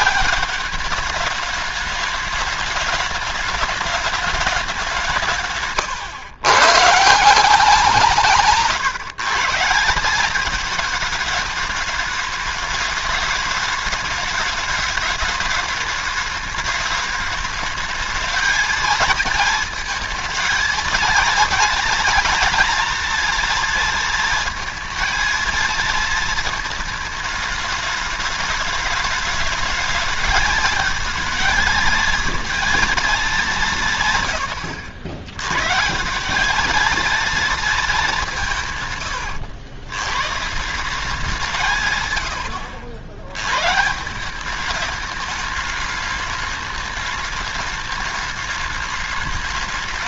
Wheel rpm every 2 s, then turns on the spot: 210, 210, 180, 150, 160, 210, 210, 210, 210, 220, 220, 230, 230, 220, 210, 220, 230, 100, 220, 130, 170, 70, 210, 210, 210.
none